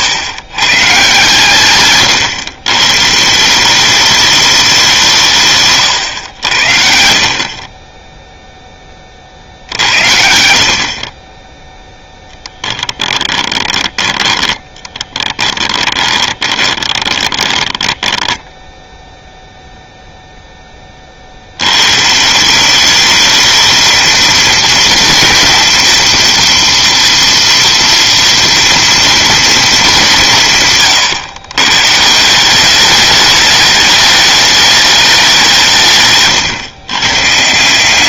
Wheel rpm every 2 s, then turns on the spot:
140, 150, 180, 70, 30, 50, 10, 10, 30, 0, 20, 200, 230, 230, 230, 140, 190, 210, 130.
14-18